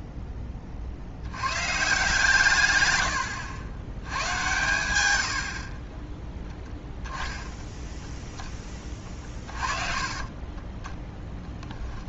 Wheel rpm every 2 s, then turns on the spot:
30, 120, 100, 0, 20, 20.
8-10